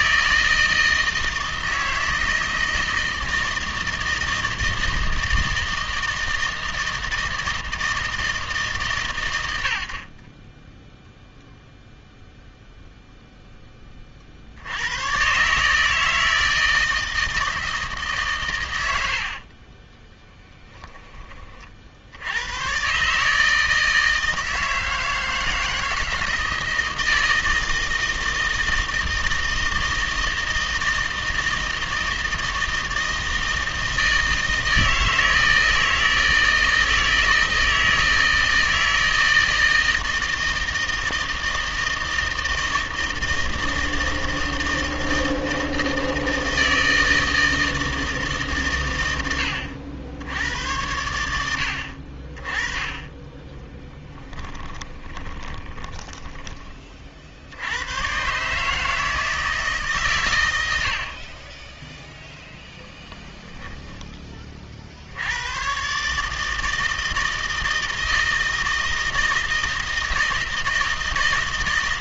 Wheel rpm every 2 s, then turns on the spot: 160, 160, 160, 160, 140, 10, 0, 100, 160, 90, 10, 130, 160, 160, 160, 160, 160, 160, 160, 160, 160, 160, 160, 160, 110, 100, 20, 10, 30, 150, 80, 0, 60, 160, 160, 160.
10-12 54-56